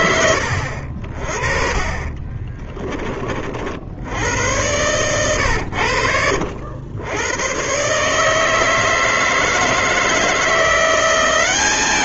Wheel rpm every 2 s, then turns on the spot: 70, 30, 110, 80, 150, 170.
2-4